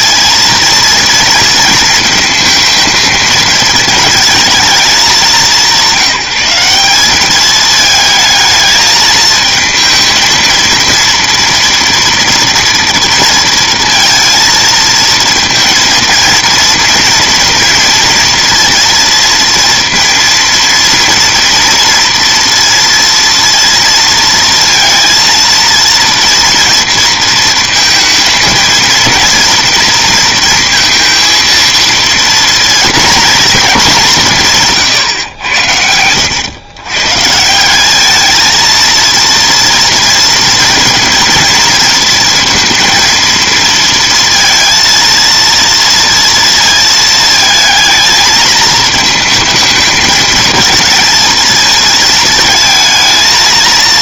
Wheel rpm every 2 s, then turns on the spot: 230, 220, 210, 180, 220, 230, 230, 230, 230, 230, 230, 230, 230, 230, 230, 230, 240, 160, 120, 230, 230, 230, 230, 230, 220, 220, 220.
34-36